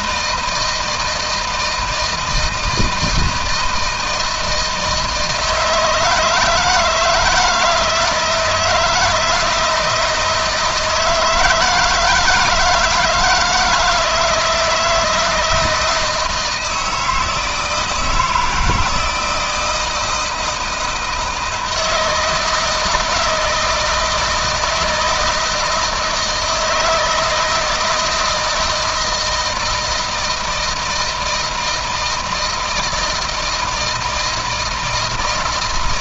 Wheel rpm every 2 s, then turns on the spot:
160, 160, 160, 160, 160, 160, 160, 160, 160, 160, 160, 160, 160, 160, 160, 170, 160, 160.
none